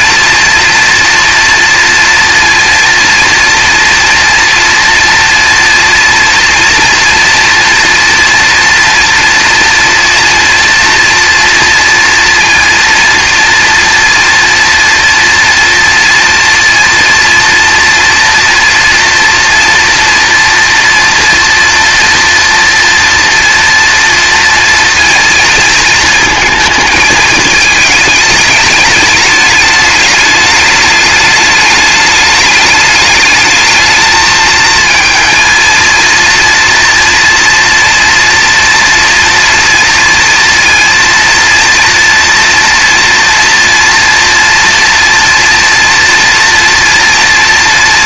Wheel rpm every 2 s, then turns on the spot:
230, 230, 230, 230, 230, 230, 230, 230, 230, 240, 230, 230, 230, 220, 210, 210, 210, 220, 230, 230, 230, 230, 230, 230.
none